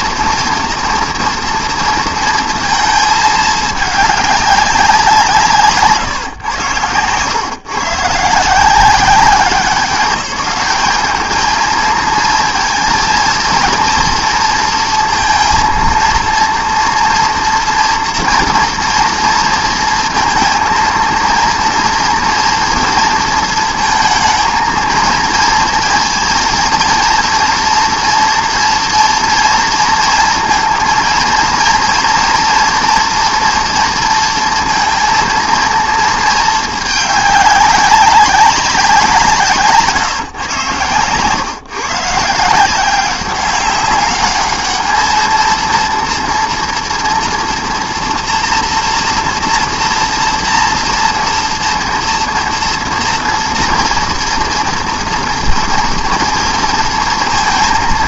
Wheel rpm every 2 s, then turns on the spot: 230, 210, 150, 130, 190, 220, 230, 230, 230, 230, 230, 230, 230, 230, 230, 230, 230, 230, 200, 160, 130, 200, 230, 230, 230, 240, 230, 240, 230.
none